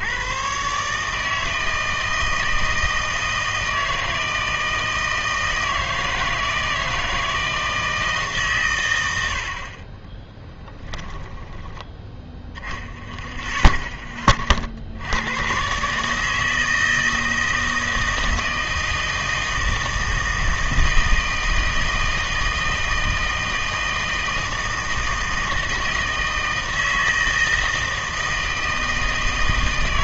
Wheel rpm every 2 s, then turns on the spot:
120, 160, 160, 160, 120, 10, 0, 50, 160, 160, 160, 160, 160, 160, 160.
10-12